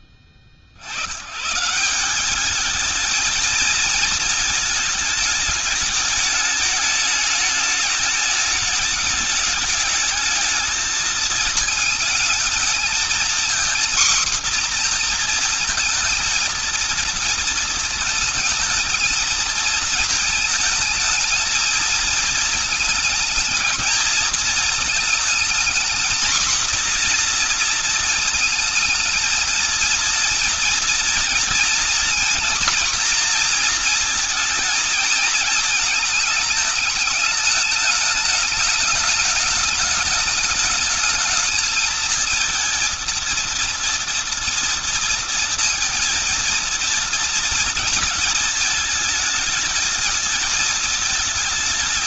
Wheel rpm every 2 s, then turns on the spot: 60, 220, 220, 210, 210, 220, 230, 240, 230, 220, 220, 220, 220, 240, 220, 230, 240, 230, 210, 210, 210, 220, 230, 230, 220, 220.
none